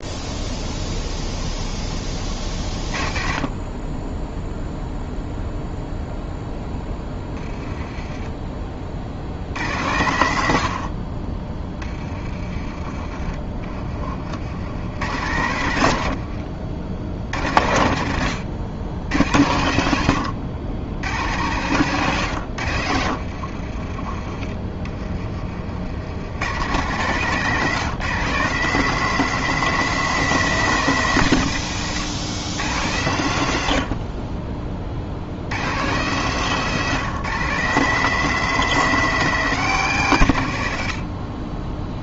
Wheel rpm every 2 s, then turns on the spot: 0, 40, 0, 10, 60, 60, 30, 110, 70, 90, 100, 80, 30, 150, 190, 160, 110, 50, 170, 190, 50.
22-24